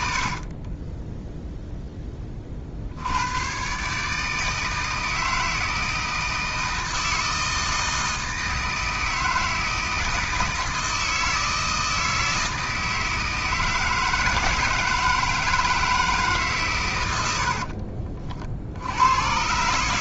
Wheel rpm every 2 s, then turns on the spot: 50, 50, 160, 160, 160, 160, 160, 160, 130, 70.
0-2